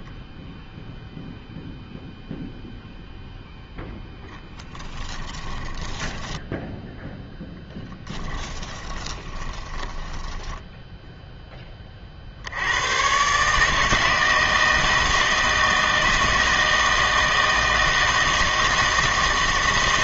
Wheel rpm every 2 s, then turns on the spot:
0, 0, 10, 10, 10, 10, 80, 160, 160, 160.
4-12